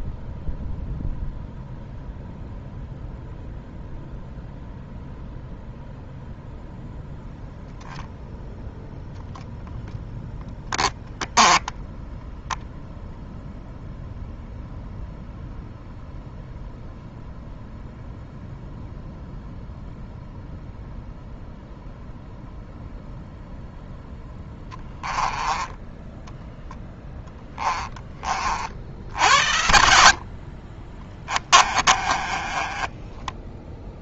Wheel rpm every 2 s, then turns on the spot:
0, 0, 0, 0, 0, 10, 0, 0, 0, 0, 0, 0, 20, 10, 60, 40, 20.
10-12 24-26 32-34